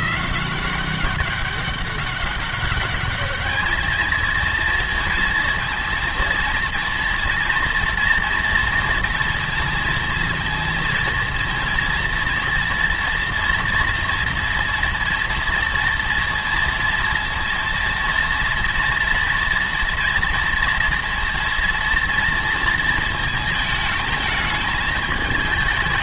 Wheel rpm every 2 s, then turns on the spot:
190, 200, 230, 230, 230, 230, 230, 230, 230, 240, 230, 230, 220.
none